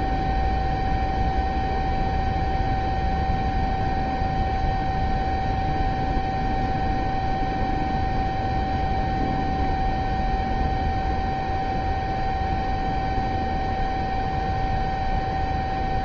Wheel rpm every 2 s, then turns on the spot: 0, 0, 0, 0, 0, 0, 0, 0.
none